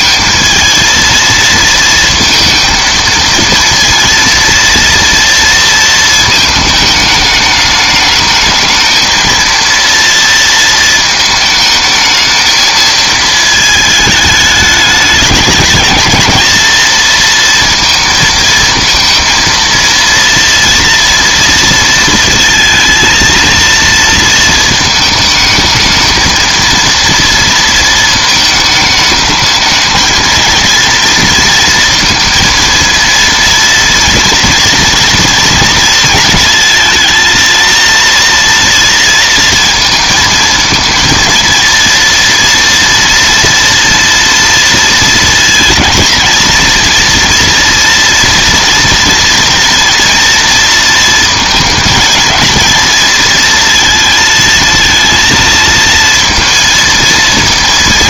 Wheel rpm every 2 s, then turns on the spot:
220, 230, 230, 210, 220, 220, 220, 210, 230, 220, 230, 230, 220, 230, 210, 230, 230, 230, 230, 230, 230, 230, 230, 230, 240, 230, 220, 230, 230.
none